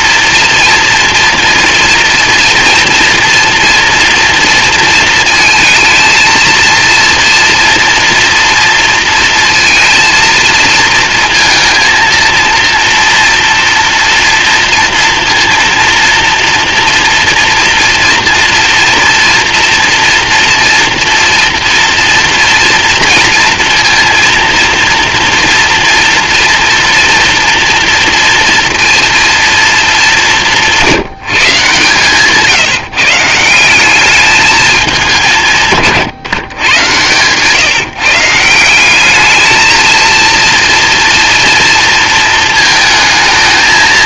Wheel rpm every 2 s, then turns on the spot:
230, 230, 230, 230, 240, 230, 230, 230, 230, 230, 230, 230, 240, 240, 230, 170, 160, 200, 120, 190, 230, 220.
36-38